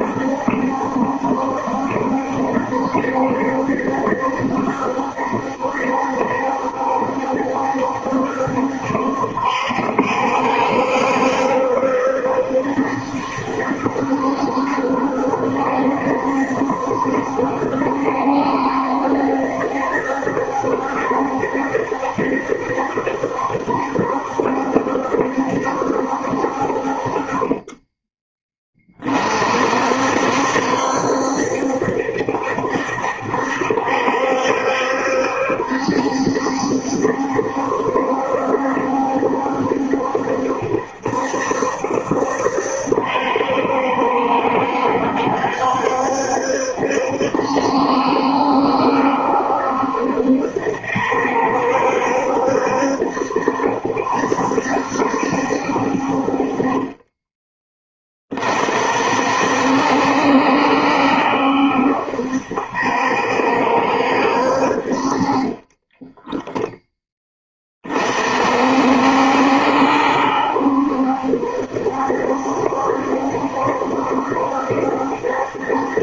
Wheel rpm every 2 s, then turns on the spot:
70, 70, 70, 70, 70, 70, 70, 70, 70, 70, 70, 70, 70, 50, 30, 70, 70, 70, 70, 70, 70, 70, 70, 70, 70, 70, 70, 70, 30, 50, 70, 70, 50, 0, 60, 70, 70, 70.
none